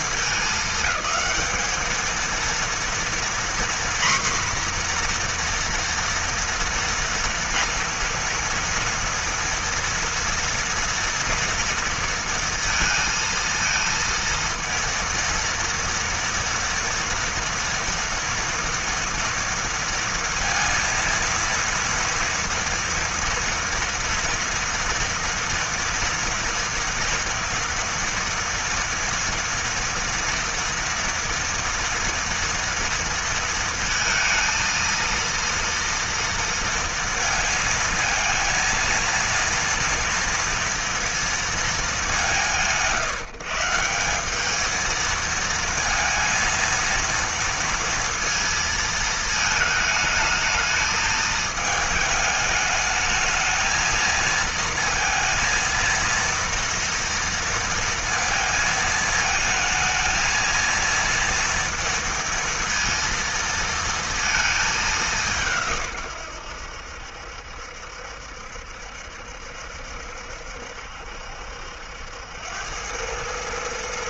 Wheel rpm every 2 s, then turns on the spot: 210, 240, 240, 230, 230, 230, 230, 230, 230, 240, 230, 230, 230, 230, 240, 230, 230, 230, 230, 230, 230, 140, 220, 230, 220, 220, 210, 230, 230, 220, 230, 230, 200, 80, 70, 70, 100.
none